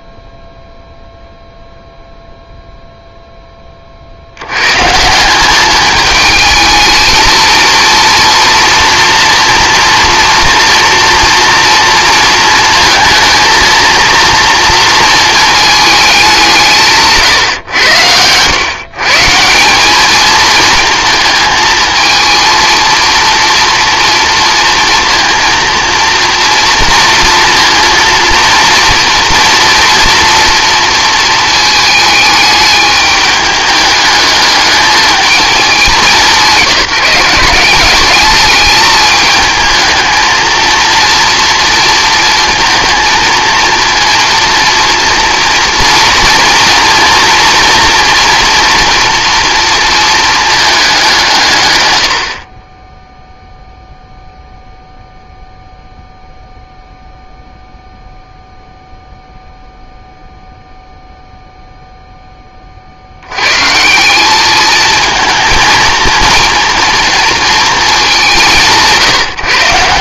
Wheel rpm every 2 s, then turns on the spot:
0, 0, 100, 220, 230, 230, 230, 230, 180, 120, 220, 230, 230, 230, 230, 230, 210, 210, 180, 210, 230, 230, 230, 230, 240, 210, 20, 0, 0, 0, 0, 30, 220, 230, 170.
none